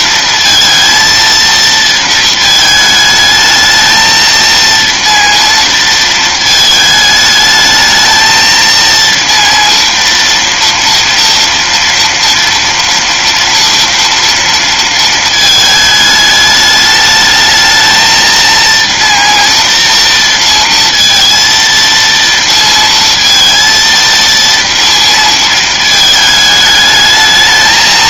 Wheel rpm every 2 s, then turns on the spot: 230, 220, 230, 220, 230, 230, 230, 230, 210, 230, 230, 230, 230, 220.
none